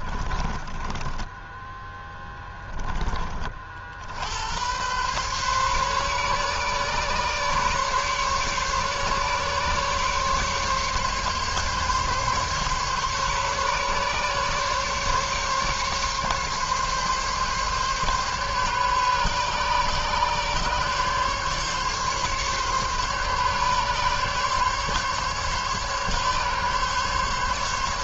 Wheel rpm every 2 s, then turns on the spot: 30, 10, 80, 140, 140, 140, 140, 140, 140, 140, 140, 140, 140, 140.
0-2